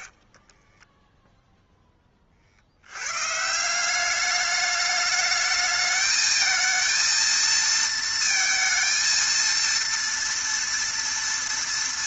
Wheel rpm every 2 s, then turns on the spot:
20, 60, 210, 220, 230, 230.
0-2